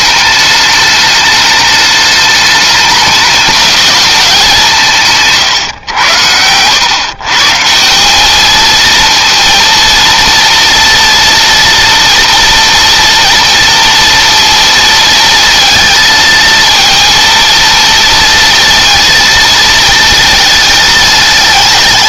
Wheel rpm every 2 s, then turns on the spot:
210, 210, 160, 120, 230, 230, 230, 230, 230, 230, 220.
none